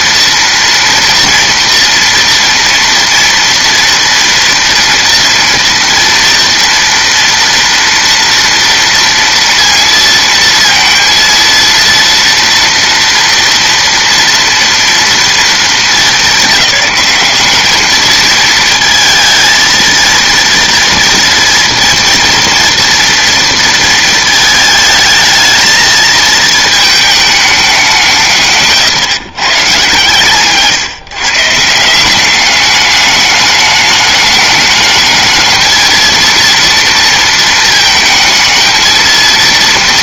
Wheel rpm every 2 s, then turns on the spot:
230, 230, 230, 230, 240, 230, 240, 230, 210, 220, 230, 230, 220, 220, 150, 150, 200, 210, 230, 220.
none